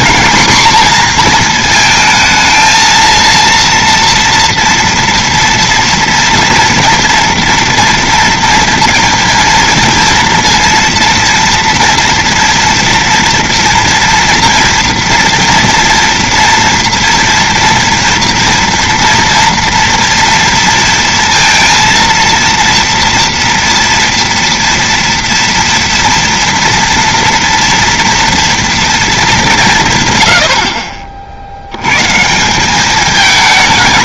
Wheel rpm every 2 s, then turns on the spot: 240, 220, 240, 240, 230, 230, 230, 230, 230, 240, 230, 230, 230, 230, 240, 120, 120.
none